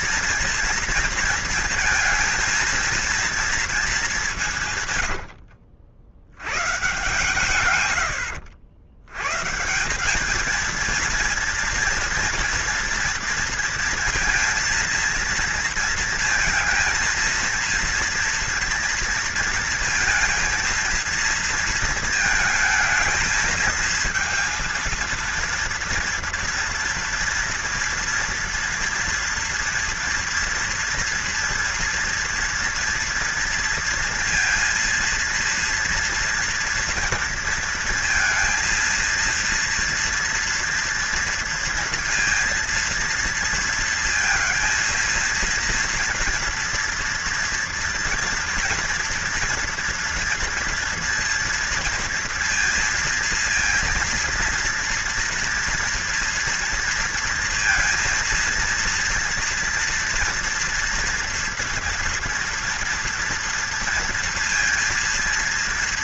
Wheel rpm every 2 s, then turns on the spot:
230, 230, 120, 130, 90, 230, 230, 230, 230, 230, 220, 220, 230, 230, 230, 230, 230, 230, 230, 230, 230, 230, 230, 230, 230, 230, 230, 240, 230, 230, 230, 230, 230.
none